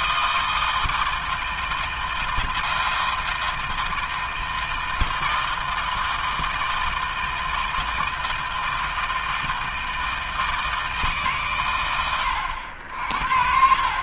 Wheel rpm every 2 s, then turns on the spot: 160, 160, 160, 160, 160, 160, 100.
none